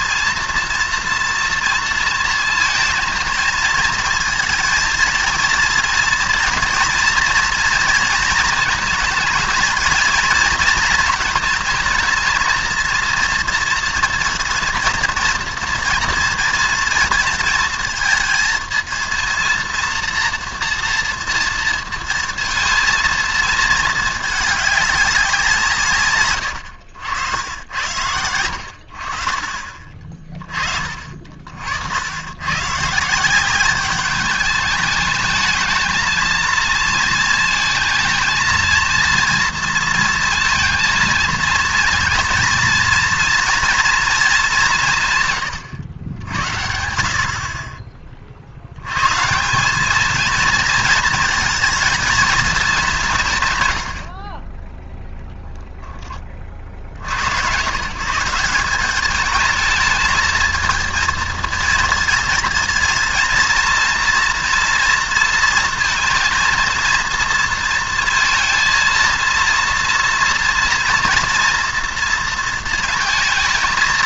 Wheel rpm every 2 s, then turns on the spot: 230, 230, 230, 240, 220, 230, 230, 230, 230, 230, 230, 220, 210, 100, 80, 30, 140, 210, 230, 230, 230, 230, 190, 60, 70, 230, 210, 20, 60, 200, 220, 230, 230, 230, 230, 240, 230.
26-30